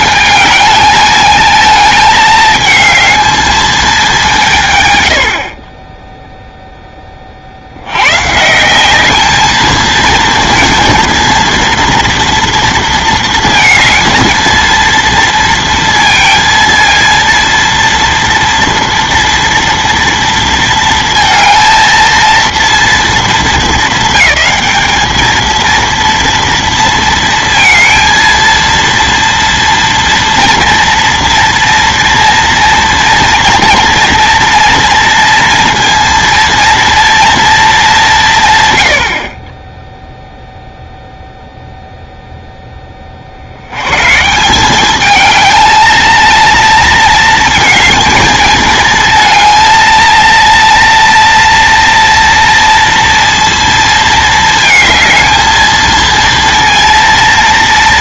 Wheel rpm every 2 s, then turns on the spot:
220, 220, 110, 0, 170, 230, 230, 230, 230, 230, 230, 230, 210, 230, 230, 230, 230, 230, 230, 130, 0, 10, 190, 230, 220, 230, 230, 220, 230.
none